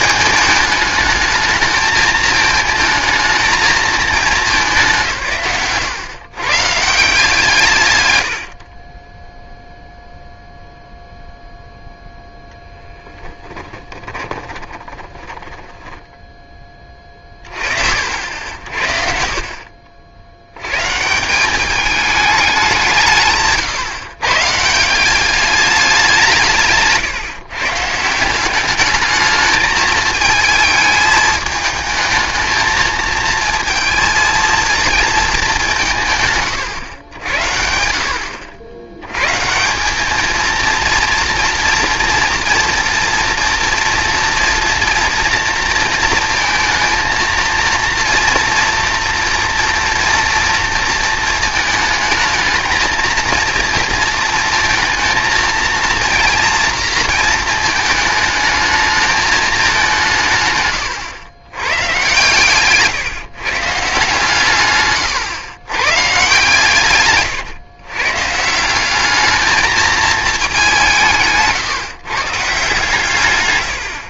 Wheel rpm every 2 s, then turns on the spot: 210, 220, 190, 130, 60, 0, 0, 20, 10, 60, 110, 190, 160, 150, 200, 220, 220, 230, 120, 90, 230, 230, 230, 230, 230, 230, 220, 230, 230, 220, 130, 130, 140, 140, 170, 190, 150.
14-16 62-66